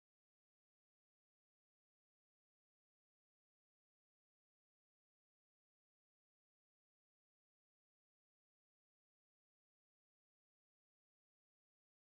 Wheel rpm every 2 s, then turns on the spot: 0, 0, 0, 0, 0, 0.
none